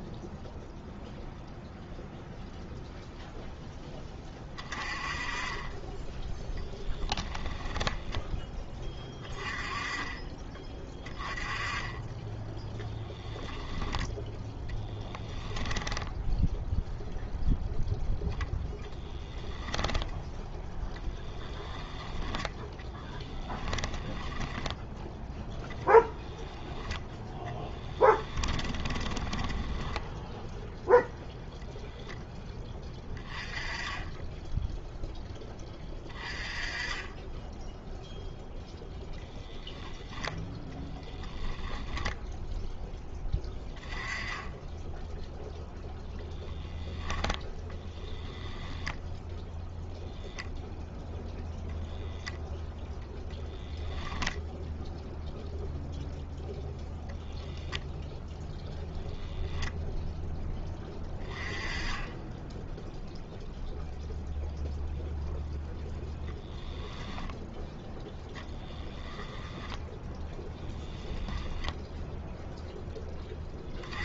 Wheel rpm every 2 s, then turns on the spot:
0, 0, 20, 10, 20, 20, 0, 10, 0, 10, 0, 10, 20, 10, 10, 0, 20, 0, 20, 0, 10, 0, 10, 10, 0, 0, 0, 0, 0, 0, 20, 0, 0, 10, 30, 10, 0.
6-8 14-16 24-26 28-30 40-42 66-72